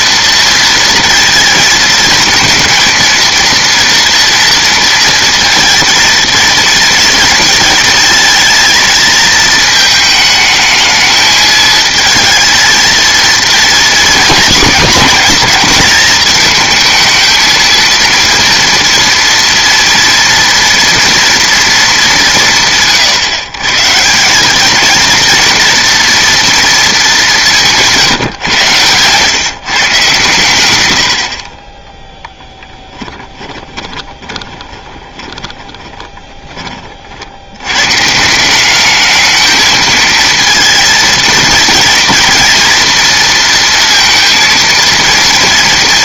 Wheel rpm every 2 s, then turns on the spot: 230, 220, 230, 230, 230, 220, 230, 220, 220, 230, 230, 140, 210, 230, 130, 120, 10, 20, 30, 190, 230, 230, 230.
32-36